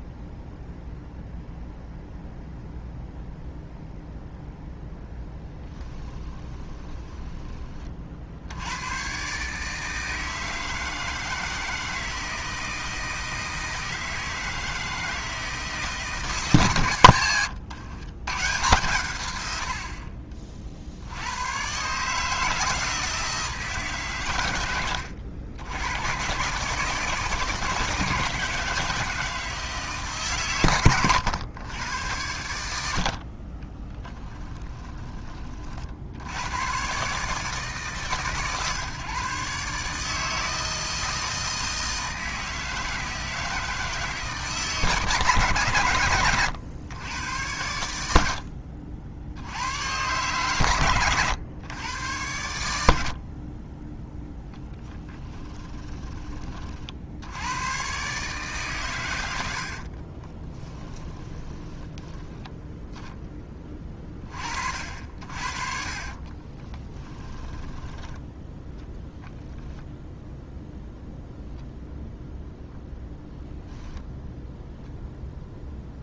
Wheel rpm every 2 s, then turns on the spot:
0, 0, 0, 20, 90, 160, 160, 160, 130, 120, 50, 160, 90, 150, 160, 110, 60, 20, 120, 140, 160, 160, 160, 100, 70, 120, 80, 10, 50, 120, 10, 10, 50, 20, 10, 0, 0, 0.
6-8 34-36 60-62 66-68